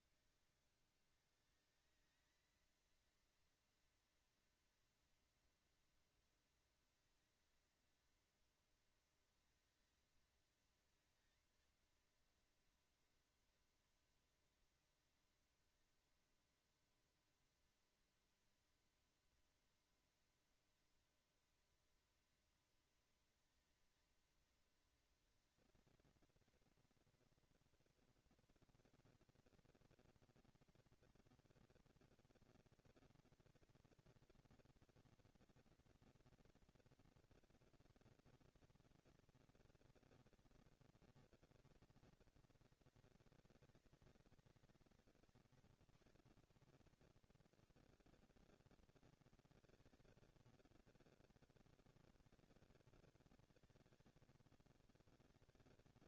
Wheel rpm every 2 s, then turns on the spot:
200, 230, 240, 230, 230, 230, 230, 230, 230, 230, 230, 230, 230, 230, 230, 230, 230, 230, 230, 220, 230, 200, 170, 100, 190, 190, 200, 200.
none